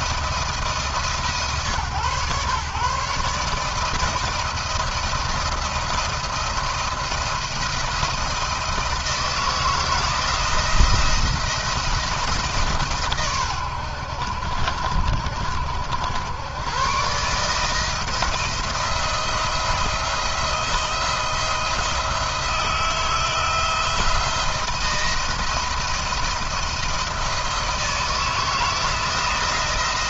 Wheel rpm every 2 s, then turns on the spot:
150, 130, 170, 170, 170, 170, 140, 60, 110, 160, 170, 160, 170, 170, 160.
none